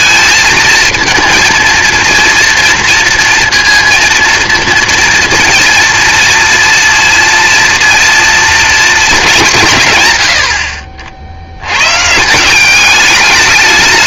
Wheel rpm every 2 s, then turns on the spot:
220, 230, 230, 240, 220, 50, 180.
none